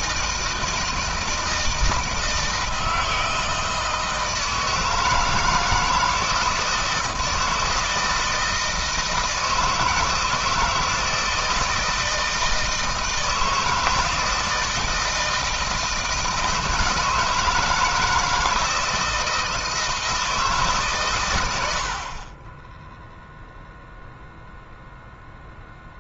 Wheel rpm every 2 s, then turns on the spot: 160, 160, 160, 160, 160, 160, 160, 160, 160, 160, 140, 20, 0.
none